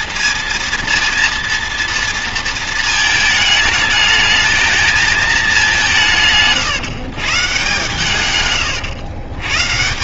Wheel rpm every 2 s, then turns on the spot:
230, 220, 220, 140, 110.
none